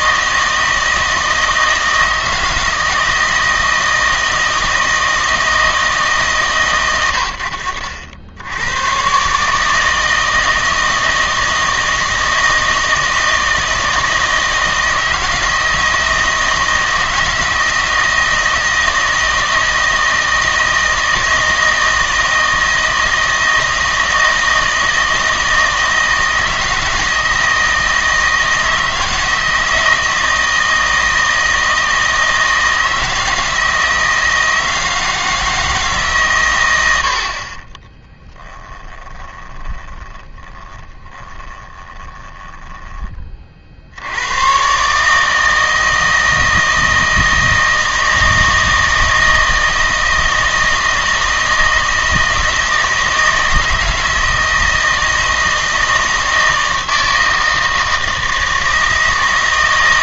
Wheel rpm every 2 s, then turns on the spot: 160, 160, 160, 130, 90, 160, 160, 160, 160, 160, 160, 160, 160, 160, 160, 160, 160, 160, 100, 10, 20, 20, 120, 160, 160, 160, 160, 160, 160, 160.
38-44